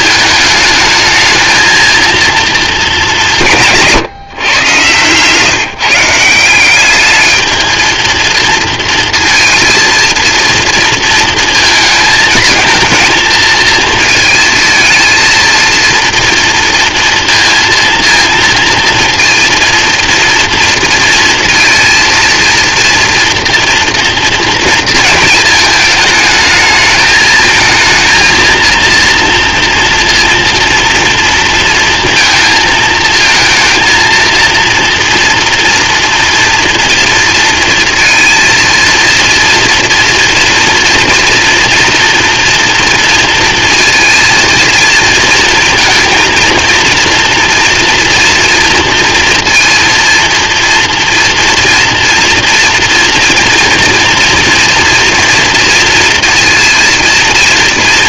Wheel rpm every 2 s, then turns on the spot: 220, 220, 130, 180, 230, 230, 220, 220, 230, 230, 230, 230, 230, 220, 230, 230, 220, 230, 240, 230, 230, 230, 230, 230, 230, 230, 230, 230, 230.
none